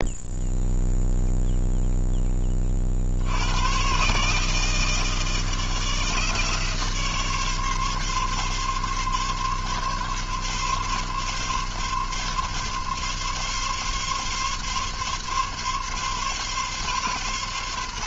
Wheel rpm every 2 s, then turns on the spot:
0, 50, 160, 150, 140, 140, 140, 140, 130.
none